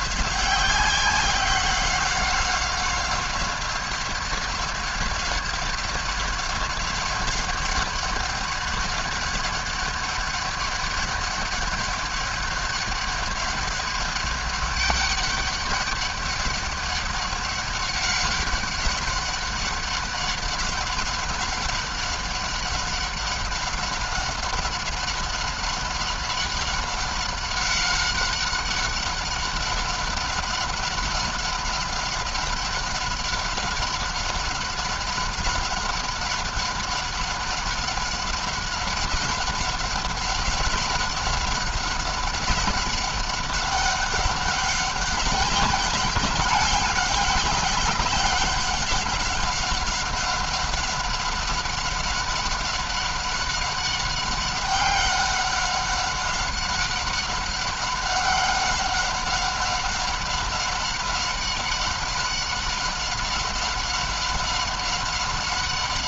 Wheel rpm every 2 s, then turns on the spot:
190, 190, 190, 190, 200, 190, 190, 200, 190, 190, 190, 190, 190, 190, 190, 190, 190, 190, 190, 190, 190, 190, 200, 200, 200, 190, 190, 200, 190, 200, 190, 190, 190.
none